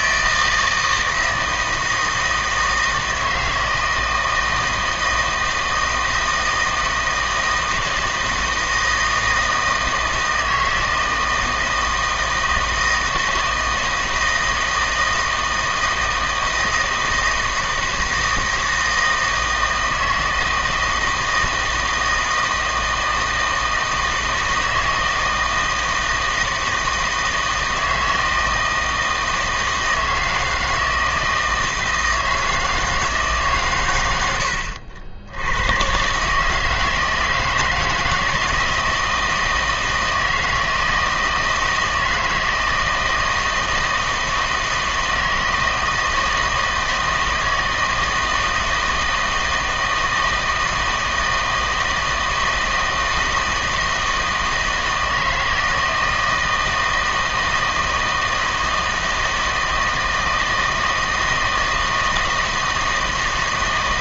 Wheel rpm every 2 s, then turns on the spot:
160, 160, 160, 160, 160, 160, 160, 160, 160, 160, 160, 160, 160, 160, 160, 160, 160, 70, 160, 160, 160, 160, 160, 160, 160, 160, 160, 160, 160, 160, 160, 160.
none